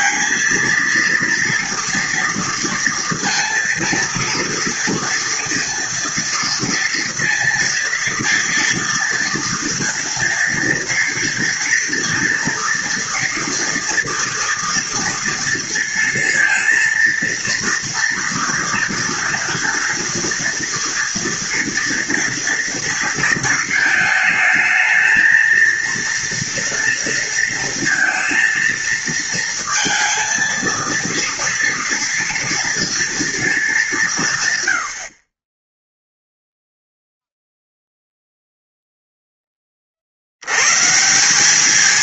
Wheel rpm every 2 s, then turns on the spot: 220, 230, 230, 230, 230, 230, 230, 230, 230, 230, 230, 230, 220, 230, 230, 230, 230, 80, 0, 0, 140.
none